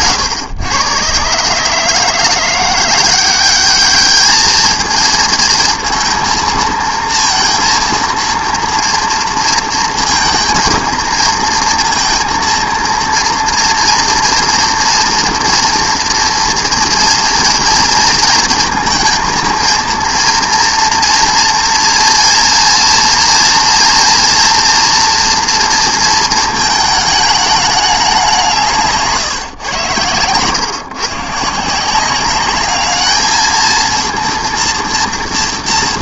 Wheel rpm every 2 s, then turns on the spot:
110, 180, 220, 230, 230, 220, 230, 230, 240, 230, 230, 240, 240, 220, 160, 130, 210, 230.
28-30